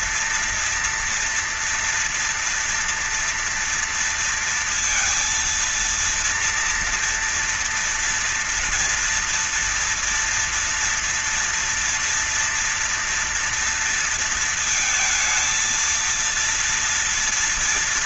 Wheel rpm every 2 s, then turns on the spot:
230, 240, 230, 230, 230, 230, 230, 230, 230.
none